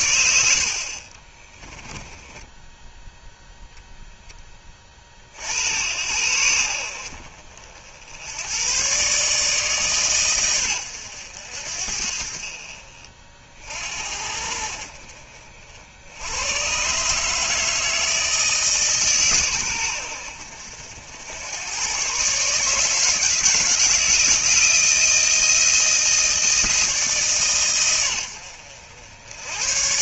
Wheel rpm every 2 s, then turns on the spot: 70, 10, 20, 70, 110, 110, 50, 70, 120, 150, 70, 150, 160, 160, 80.
none